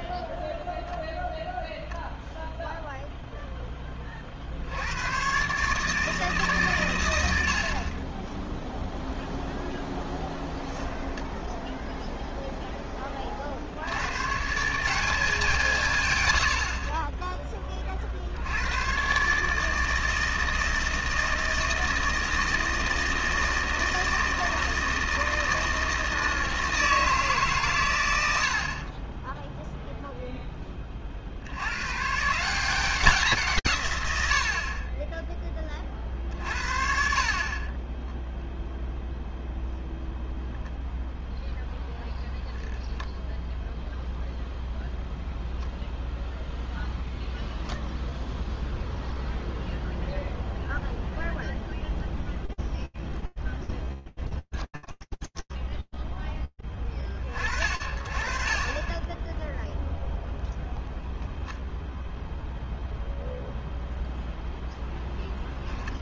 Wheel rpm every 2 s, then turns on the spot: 0, 0, 120, 90, 0, 0, 40, 190, 20, 130, 160, 160, 160, 150, 0, 50, 170, 10, 50, 0, 0, 0, 0, 0, 0, 0, 0, 10, 40, 10, 0, 0, 0.
54-56